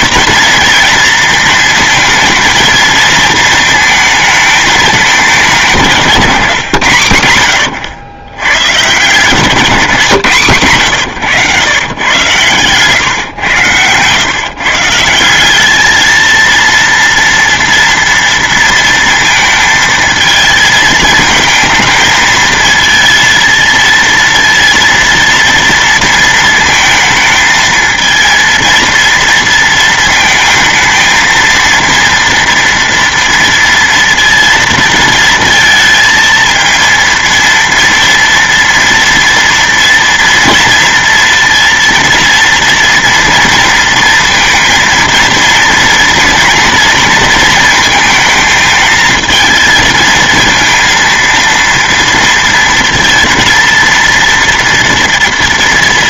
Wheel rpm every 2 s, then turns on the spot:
230, 220, 220, 140, 120, 160, 120, 130, 230, 230, 220, 220, 230, 230, 230, 230, 230, 230, 230, 230, 230, 230, 230, 230, 220, 220, 230, 230.
none